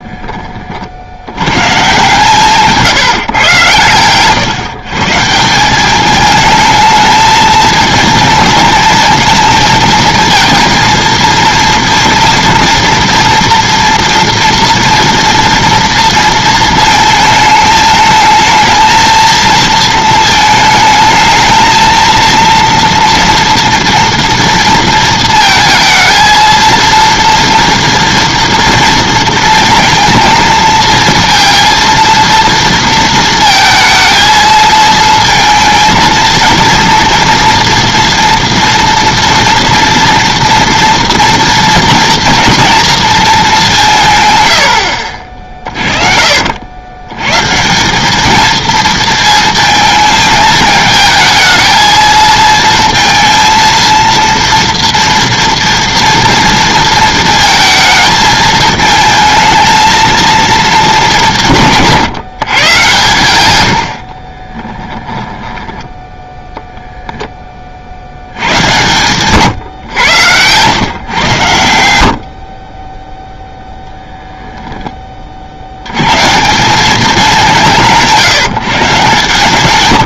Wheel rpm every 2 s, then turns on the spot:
40, 160, 140, 220, 230, 230, 230, 230, 220, 220, 220, 230, 230, 230, 230, 230, 230, 220, 230, 230, 230, 230, 80, 70, 220, 220, 230, 230, 230, 220, 220, 130, 20, 0, 110, 120, 20, 10, 190, 150.
44-46 64-66